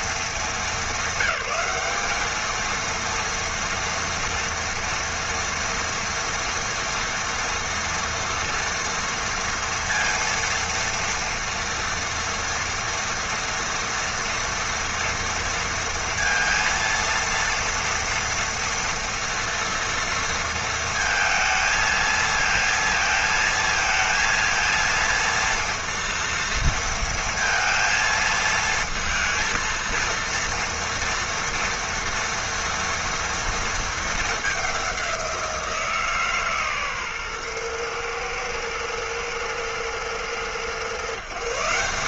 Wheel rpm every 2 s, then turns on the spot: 200, 220, 240, 230, 230, 230, 230, 230, 230, 230, 230, 230, 230, 230, 220, 230, 230, 210, 140, 110, 120.
none